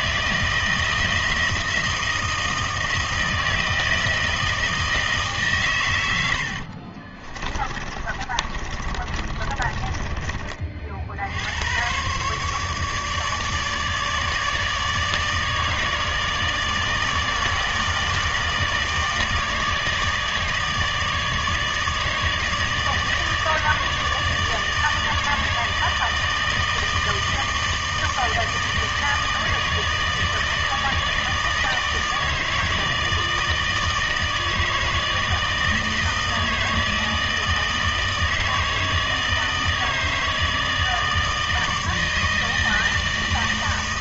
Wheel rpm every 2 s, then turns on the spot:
160, 160, 160, 60, 30, 40, 150, 150, 150, 160, 150, 150, 150, 160, 160, 160, 160, 160, 160, 160, 160, 160.
6-10